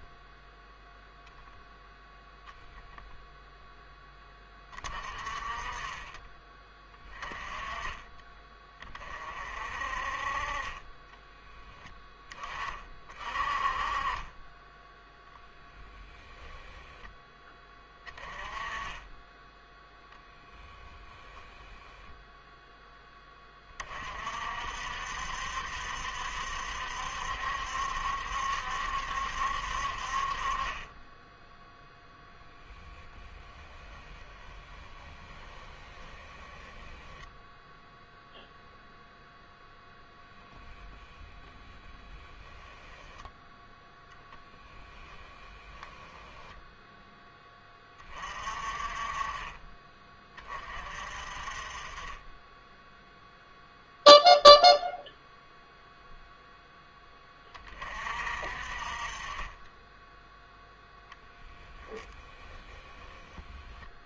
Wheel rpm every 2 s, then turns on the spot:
0, 0, 30, 20, 20, 20, 20, 10, 0, 10, 0, 0, 60, 70, 70, 30, 10, 10, 10, 0, 0, 0, 10, 0, 30, 30, 10, 0, 10, 40, 0, 10.
34-38 44-46